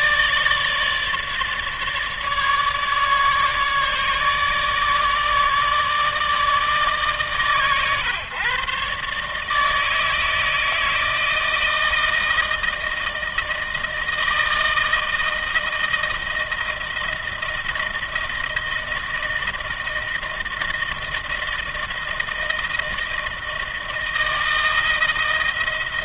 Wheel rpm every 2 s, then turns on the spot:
150, 150, 150, 150, 130, 160, 160, 160, 160, 160, 160, 160, 160.
none